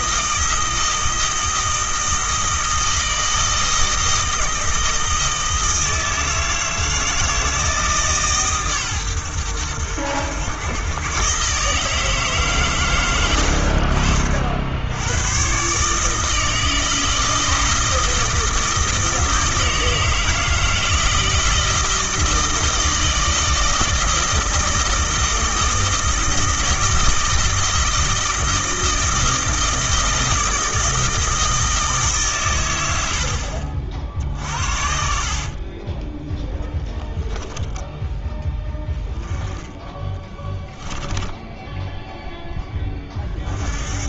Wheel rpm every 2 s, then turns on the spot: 160, 160, 160, 160, 130, 120, 130, 80, 160, 160, 160, 160, 160, 160, 160, 160, 100, 50, 10, 10, 10, 10.
34-36 40-42